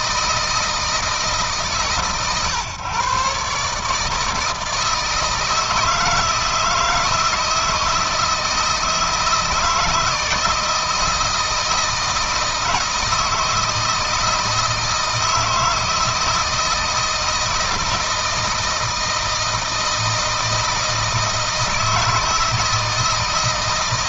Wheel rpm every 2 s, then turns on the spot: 160, 130, 160, 160, 160, 160, 160, 160, 160, 160, 160, 160.
none